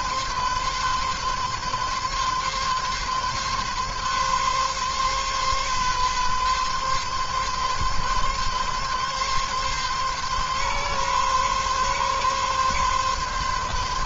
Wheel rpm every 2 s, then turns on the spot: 140, 130, 140, 140, 140, 140, 140.
none